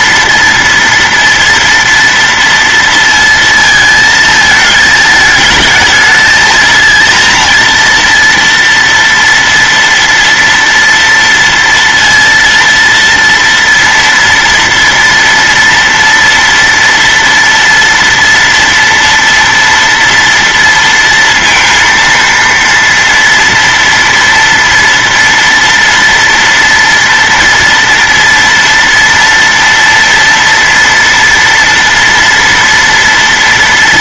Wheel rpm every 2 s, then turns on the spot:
230, 230, 220, 230, 230, 230, 230, 230, 230, 230, 230, 230, 230, 230, 240, 230, 230.
none